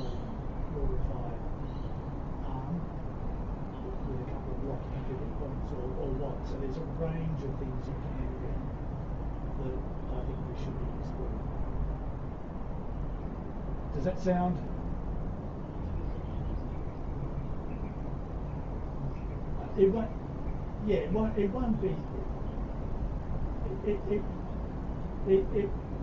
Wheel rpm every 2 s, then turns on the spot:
0, 0, 0, 0, 0, 0, 0, 0, 0, 0, 0, 0, 0.
none